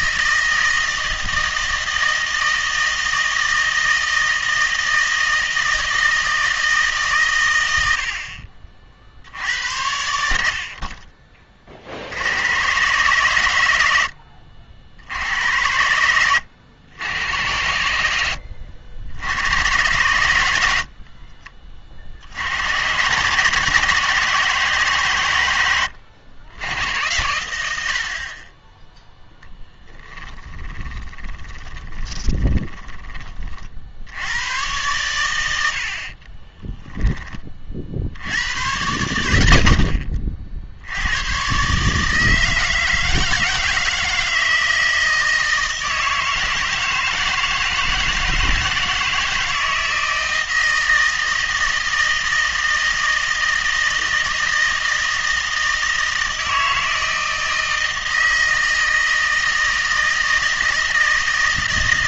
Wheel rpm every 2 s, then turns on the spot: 160, 160, 160, 150, 40, 40, 120, 70, 90, 70, 60, 110, 150, 110, 10, 20, 20, 110, 10, 110, 90, 160, 160, 160, 160, 160, 160, 160, 160, 160, 160.
30-32 36-38